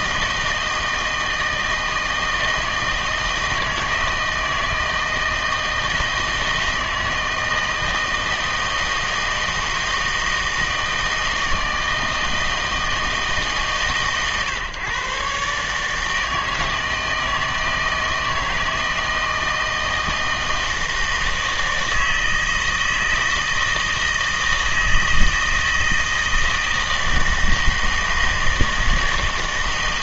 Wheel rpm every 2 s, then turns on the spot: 160, 160, 160, 160, 160, 160, 160, 130, 160, 160, 160, 160, 160, 160, 160.
none